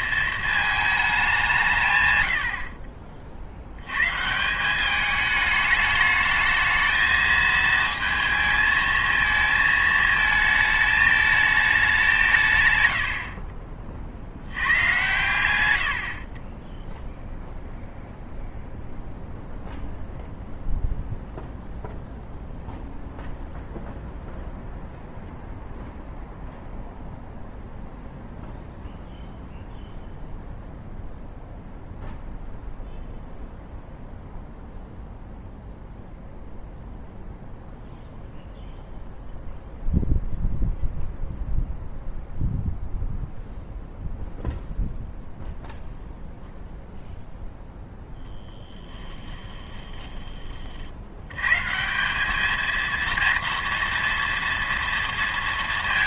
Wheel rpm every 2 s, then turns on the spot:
220, 50, 190, 220, 220, 220, 110, 110, 10, 0, 0, 0, 0, 0, 0, 0, 0, 0, 0, 0, 0, 0, 0, 0, 10, 60, 230, 230.
48-50